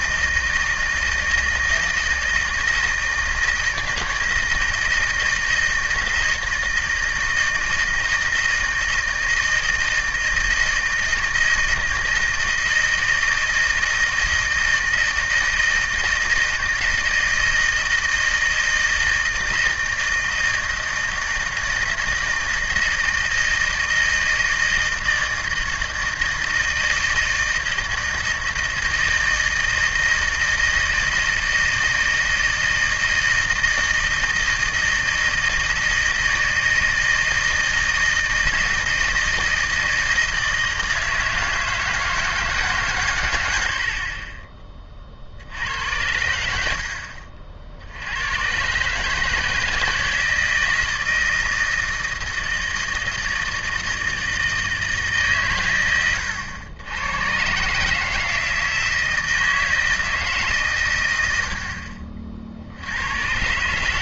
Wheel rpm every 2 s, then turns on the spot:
160, 160, 160, 160, 160, 160, 160, 160, 160, 160, 160, 160, 160, 160, 160, 160, 160, 160, 160, 160, 160, 140, 20, 70, 130, 160, 160, 160, 100, 160, 140, 70.
none